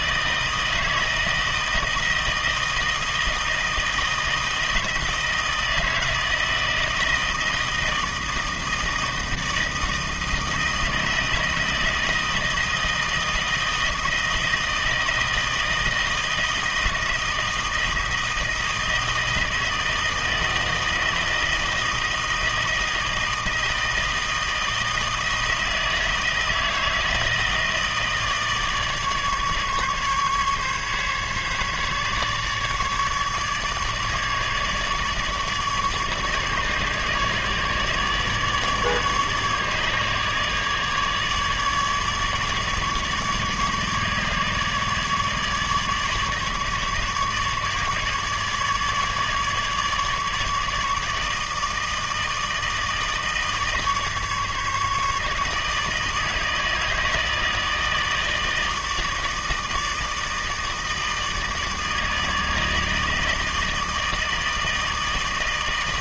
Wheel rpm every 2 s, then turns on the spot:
160, 160, 160, 160, 160, 160, 160, 160, 160, 160, 160, 160, 160, 160, 150, 140, 150, 150, 150, 150, 150, 150, 150, 150, 150, 150, 160, 150, 160, 160, 160, 160, 160.
none